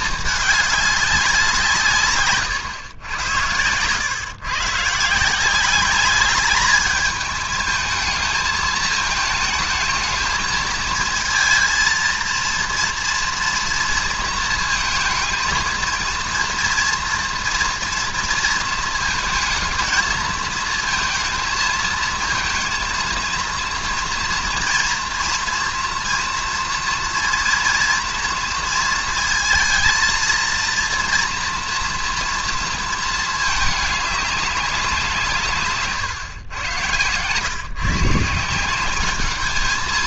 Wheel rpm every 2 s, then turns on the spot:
210, 120, 130, 210, 220, 220, 230, 230, 230, 230, 220, 230, 230, 230, 230, 230, 230, 200, 120, 160.
none